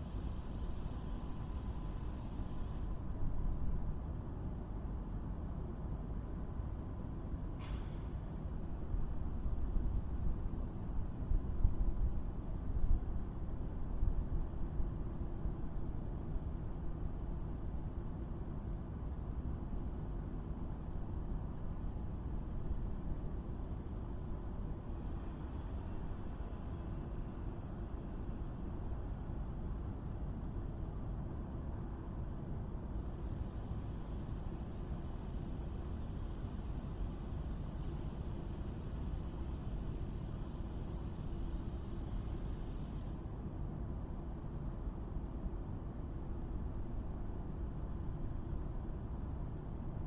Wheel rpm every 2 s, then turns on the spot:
0, 0, 0, 0, 0, 0, 0, 0, 0, 0, 0, 0, 0, 0, 0, 0, 0, 0, 0, 0, 0, 0, 0, 0, 0.
none